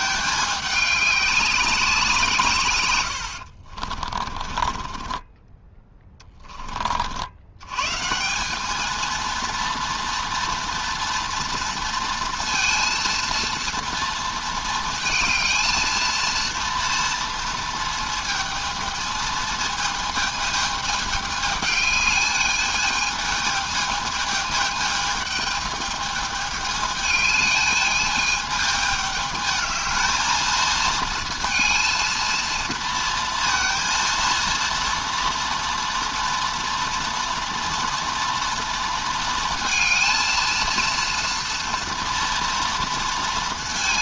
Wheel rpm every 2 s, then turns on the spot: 200, 130, 30, 40, 210, 230, 230, 230, 230, 220, 210, 220, 220, 210, 210, 220, 230, 230, 240, 230, 230, 230.
4-6